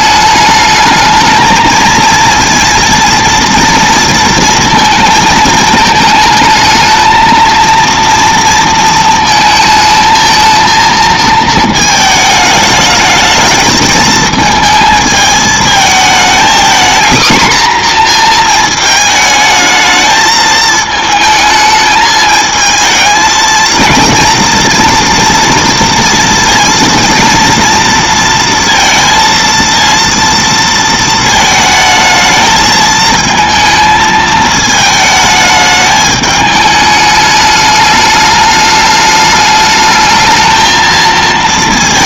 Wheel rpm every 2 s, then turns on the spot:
210, 230, 230, 220, 230, 220, 210, 220, 230, 230, 220, 220, 230, 230, 230, 230, 220, 220, 210, 210, 220.
none